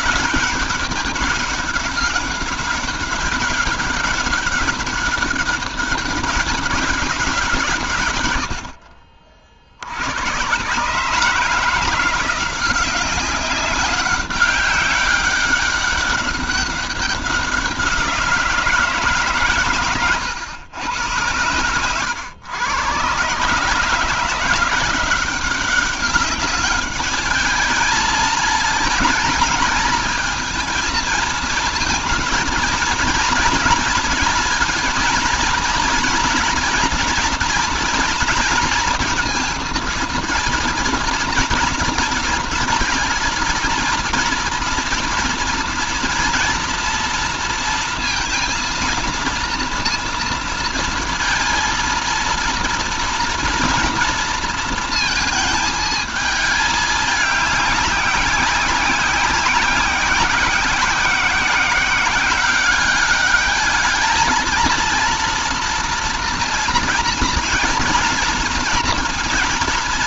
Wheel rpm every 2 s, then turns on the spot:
200, 190, 200, 200, 60, 130, 190, 200, 190, 160, 110, 120, 180, 210, 220, 230, 230, 230, 240, 230, 230, 220, 230, 230, 230, 230, 230, 230, 210, 190, 180, 200, 230, 230, 230.
none